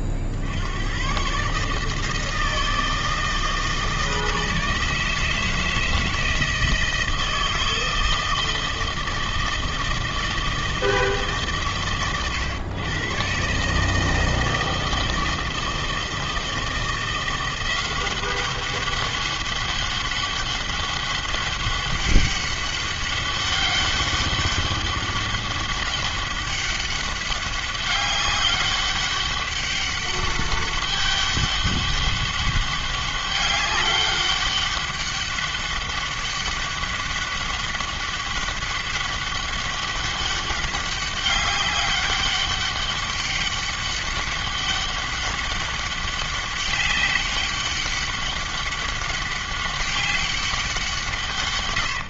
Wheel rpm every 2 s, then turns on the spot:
60, 160, 160, 160, 160, 160, 120, 160, 160, 190, 200, 200, 200, 200, 200, 200, 200, 200, 200, 200, 200, 200, 200, 200, 200, 190.
none